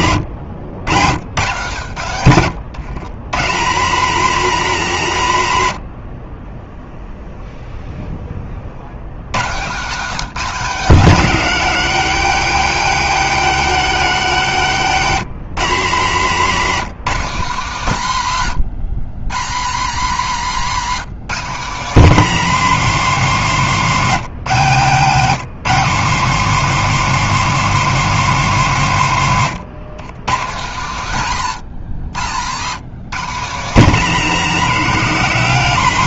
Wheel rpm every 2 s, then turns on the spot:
100, 130, 120, 0, 110, 190, 210, 170, 180, 130, 170, 190, 170, 210, 140, 140, 150, 190.
none